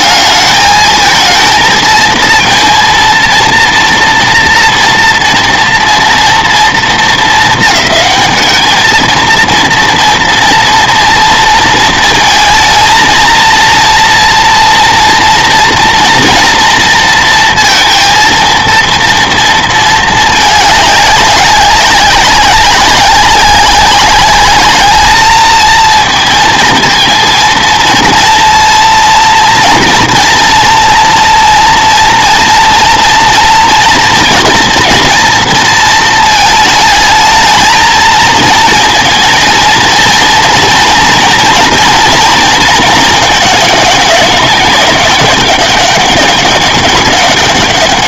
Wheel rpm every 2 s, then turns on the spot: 210, 230, 240, 230, 220, 230, 230, 240, 230, 230, 210, 190, 210, 230, 230, 230, 230, 240, 220, 230, 240, 220, 200, 200.
none